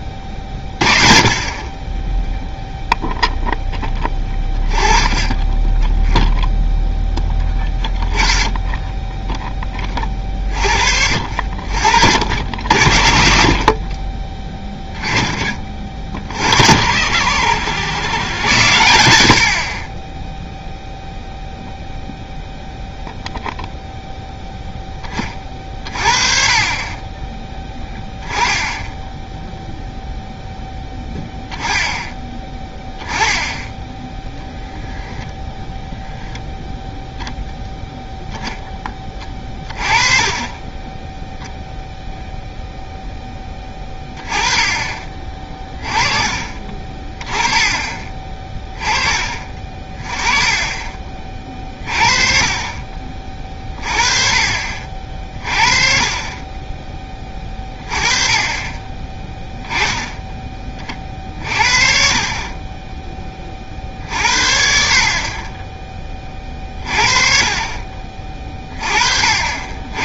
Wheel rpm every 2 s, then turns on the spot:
30, 0, 20, 0, 10, 40, 70, 10, 60, 80, 0, 0, 20, 30, 10, 0, 10, 0, 0, 10, 10, 0, 30, 30, 20, 20, 40, 40, 20, 20, 20, 20, 50, 40, 30.
28-30